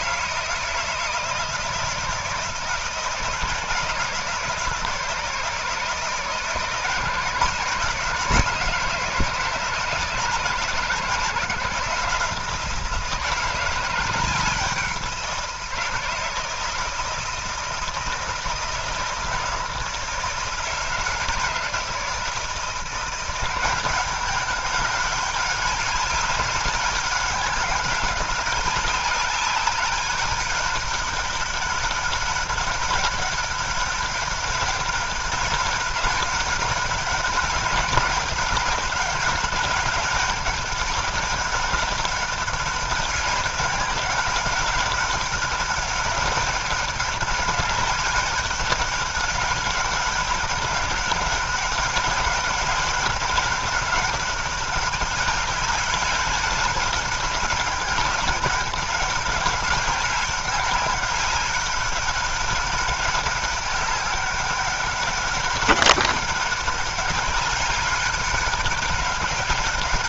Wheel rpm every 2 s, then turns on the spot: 160, 170, 160, 150, 160, 160, 160, 180, 170, 160, 160, 170, 200, 200, 190, 200, 190, 200, 200, 200, 200, 200, 200, 200, 200, 200, 200, 200, 200, 200, 200, 200, 190, 200, 200.
none